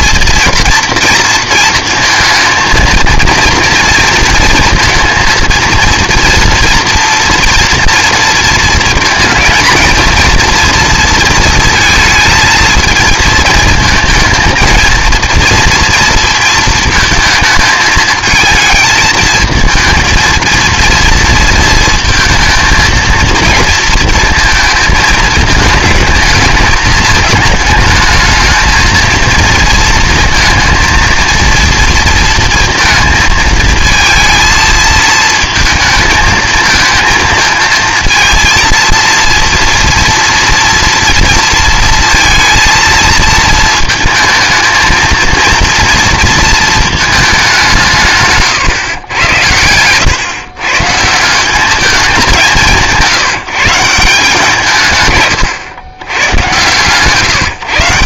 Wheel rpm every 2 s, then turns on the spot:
230, 230, 230, 230, 230, 230, 230, 220, 220, 220, 230, 220, 220, 210, 230, 230, 220, 220, 220, 230, 230, 230, 220, 220, 140, 130, 180, 160, 120.
none